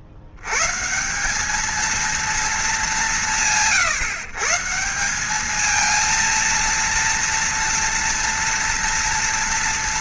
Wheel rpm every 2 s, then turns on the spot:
70, 180, 150, 230, 230.
none